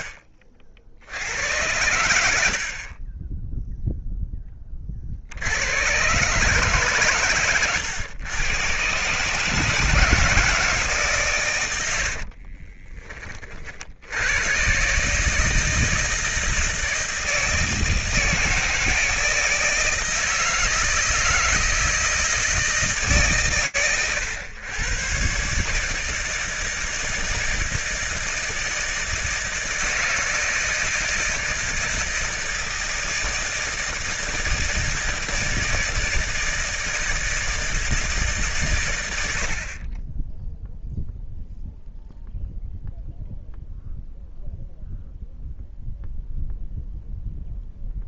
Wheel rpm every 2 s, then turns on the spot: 60, 30, 40, 130, 130, 140, 20, 120, 160, 160, 160, 150, 120, 160, 160, 160, 160, 160, 160, 130, 0, 0, 0, 0.
none